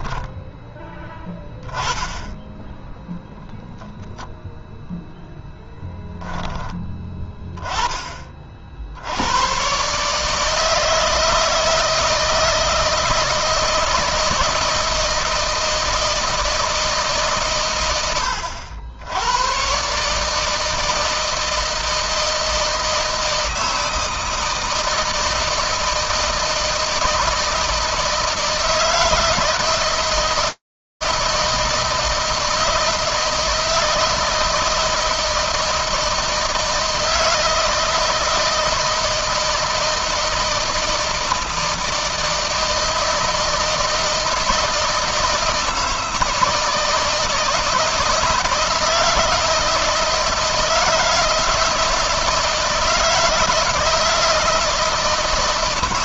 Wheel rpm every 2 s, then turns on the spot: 10, 0, 0, 20, 70, 160, 160, 160, 160, 90, 150, 160, 160, 160, 160, 160, 160, 160, 160, 160, 160, 160, 160, 160, 160, 160, 160, 160.
none